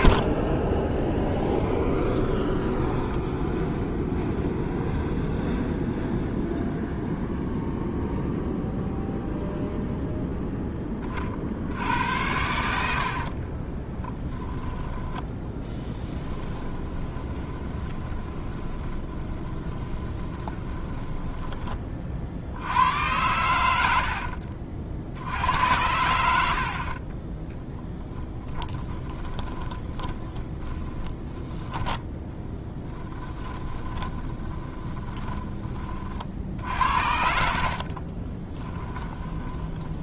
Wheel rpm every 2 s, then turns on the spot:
20, 10, 0, 0, 0, 10, 80, 10, 10, 20, 20, 80, 50, 50, 20, 10, 10, 20, 60, 20.
2-4 16-22 28-36 38-40